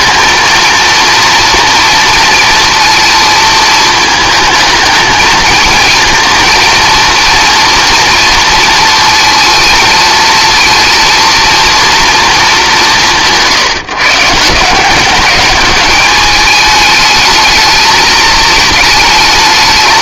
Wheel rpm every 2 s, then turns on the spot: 230, 230, 220, 230, 220, 230, 170, 200, 220, 220.
none